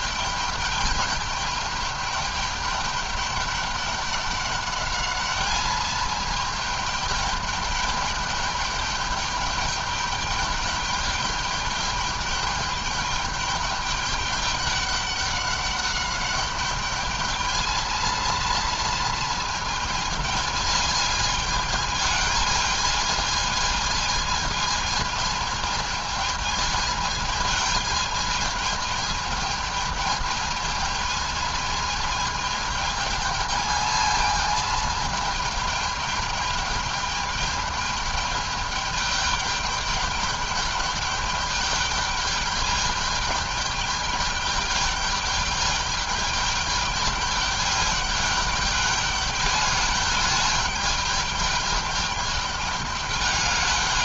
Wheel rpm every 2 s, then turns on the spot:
210, 210, 210, 210, 200, 210, 210, 200, 210, 230, 210, 220, 220, 220, 220, 220, 220, 220, 210, 210, 210, 210, 210, 210, 210, 210, 210.
none